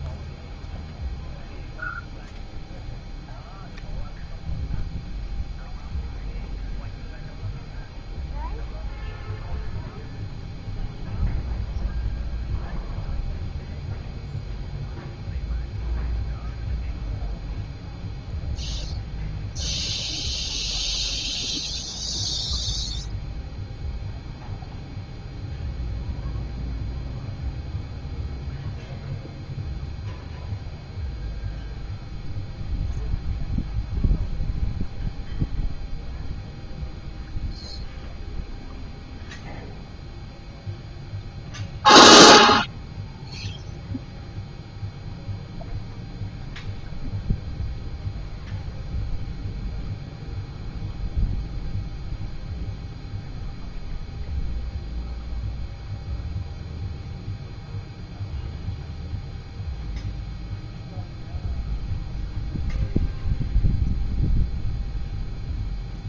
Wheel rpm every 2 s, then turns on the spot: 0, 0, 0, 0, 0, 0, 0, 0, 0, 0, 0, 0, 0, 0, 0, 0, 0, 0, 0, 0, 0, 0, 0, 0, 0, 0, 0, 0, 0, 0, 0, 0, 0.
none